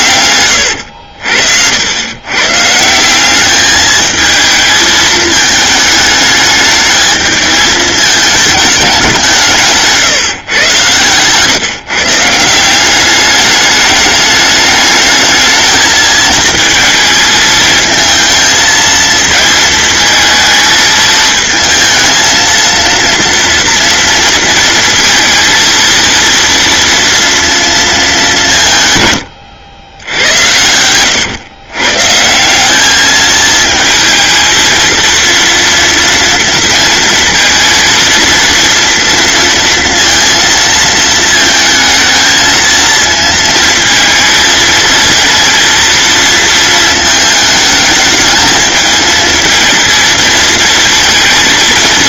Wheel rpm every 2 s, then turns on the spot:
90, 160, 220, 210, 200, 120, 190, 210, 220, 220, 220, 230, 230, 230, 150, 100, 200, 230, 230, 230, 230, 220, 230, 220, 220, 230.
0-2